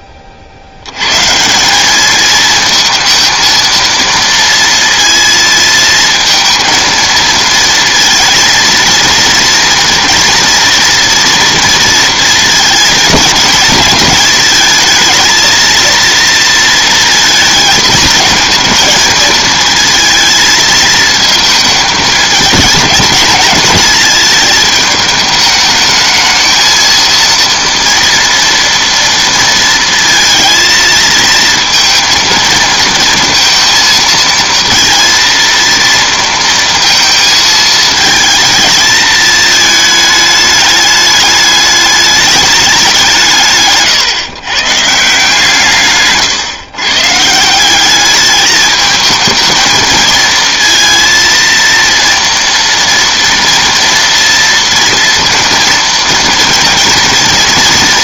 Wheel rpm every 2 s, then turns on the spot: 120, 230, 230, 230, 230, 240, 220, 220, 220, 230, 220, 210, 210, 230, 230, 220, 230, 230, 230, 220, 210, 170, 150, 140, 220, 230, 230, 230, 230.
none